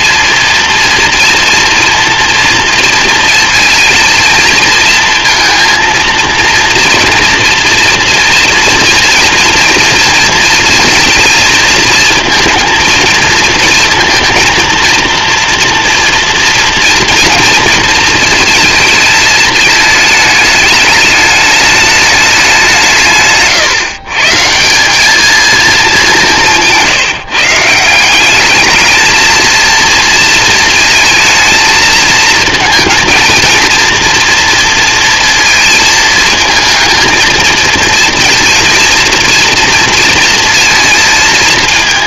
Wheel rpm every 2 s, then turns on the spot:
220, 230, 230, 230, 230, 240, 230, 230, 230, 230, 220, 210, 140, 210, 150, 230, 220, 230, 220, 220, 230.
none